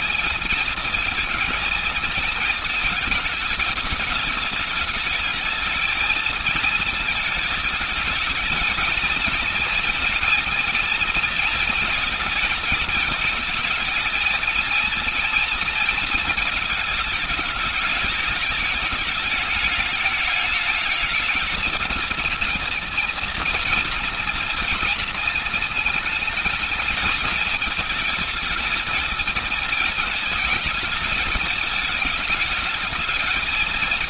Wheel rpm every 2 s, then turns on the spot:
220, 220, 210, 220, 220, 230, 220, 230, 220, 210, 220, 230, 230, 230, 220, 220, 210.
none